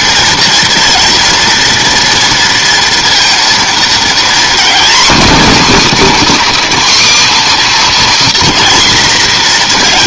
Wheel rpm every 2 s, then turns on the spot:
230, 230, 250, 280, 240.
none